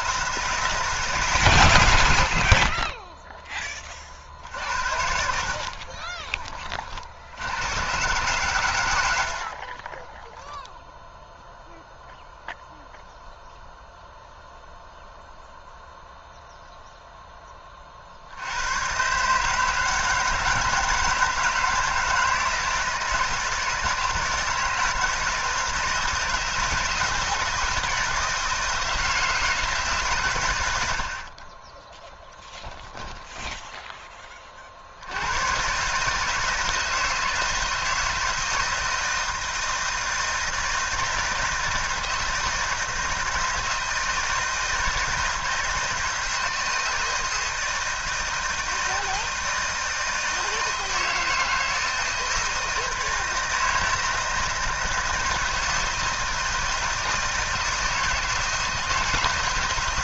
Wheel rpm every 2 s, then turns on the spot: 160, 40, 60, 50, 120, 10, 0, 0, 0, 110, 160, 160, 160, 160, 160, 90, 10, 50, 160, 160, 160, 160, 160, 160, 160, 160, 160, 160, 160, 160.
32-34